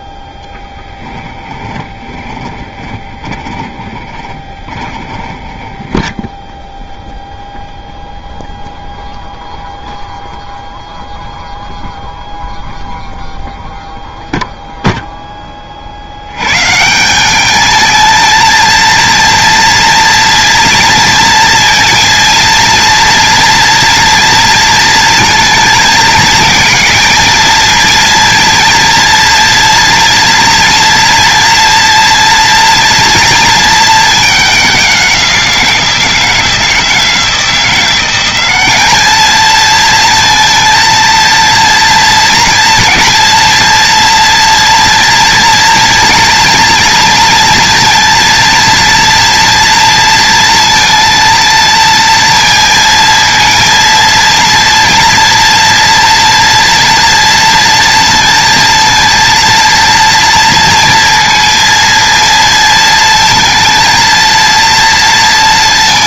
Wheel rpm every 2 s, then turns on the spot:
10, 10, 10, 0, 0, 0, 0, 0, 160, 230, 230, 230, 230, 230, 230, 230, 240, 190, 160, 210, 230, 230, 230, 230, 230, 230, 230, 240, 230, 230, 230, 230, 230.
0-6